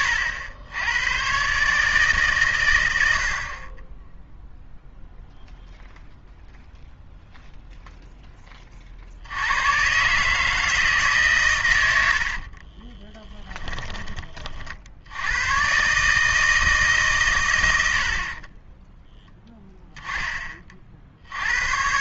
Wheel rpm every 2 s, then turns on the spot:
100, 100, 0, 0, 50, 150, 30, 60, 150, 10, 50.
12-14